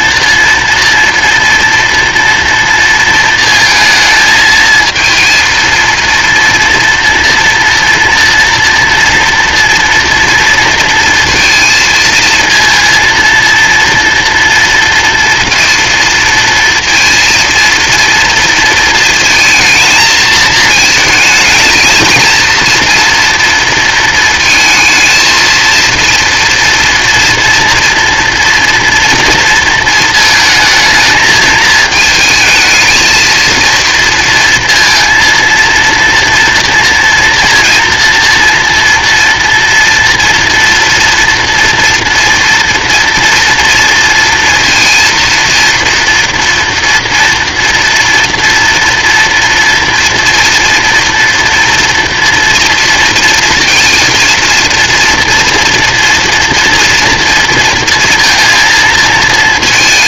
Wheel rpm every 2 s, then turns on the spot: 230, 230, 220, 230, 230, 230, 230, 230, 230, 230, 220, 230, 230, 230, 240, 220, 220, 230, 230, 230, 240, 240, 230, 230, 230, 240, 230, 230, 230, 230.
none